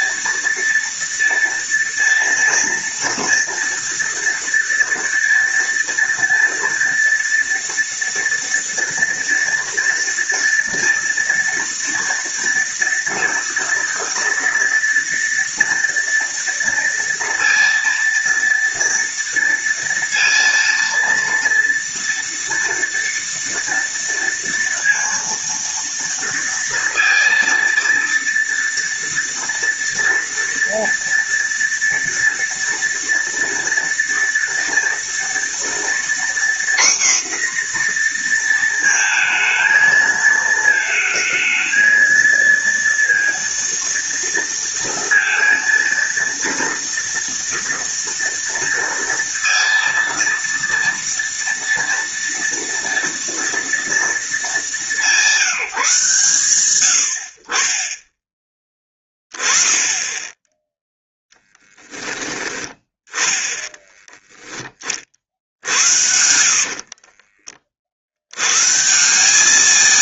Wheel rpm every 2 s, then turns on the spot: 230, 230, 230, 230, 230, 230, 230, 230, 230, 230, 230, 230, 230, 230, 230, 230, 230, 230, 250, 230, 220, 230, 230, 240, 230, 230, 230, 200, 110, 20, 10, 10, 30, 70, 120.
66-68